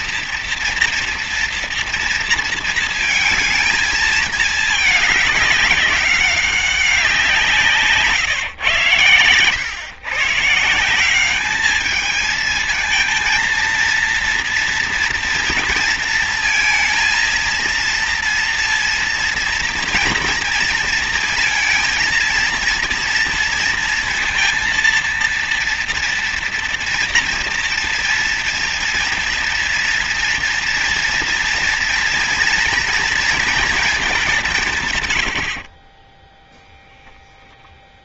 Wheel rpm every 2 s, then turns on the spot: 230, 230, 220, 190, 120, 160, 220, 230, 230, 230, 230, 230, 230, 230, 230, 230, 230, 150, 0.
none